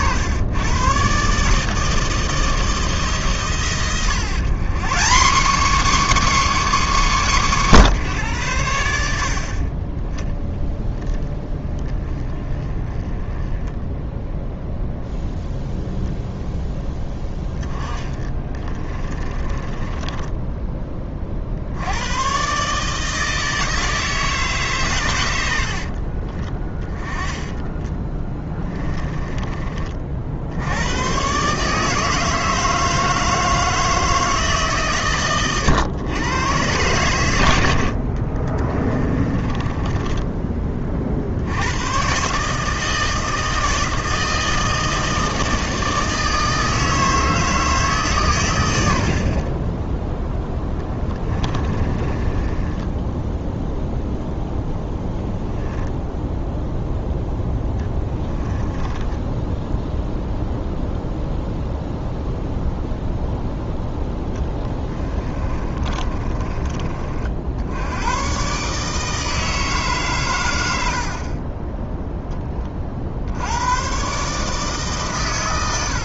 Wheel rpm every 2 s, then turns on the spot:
110, 160, 170, 280, 100, 0, 20, 0, 0, 20, 20, 140, 140, 20, 20, 100, 160, 140, 120, 30, 20, 150, 160, 160, 80, 10, 20, 10, 10, 20, 0, 0, 10, 30, 140, 80, 30, 150.
18-20 26-30 38-40 50-56 58-60 64-66 70-72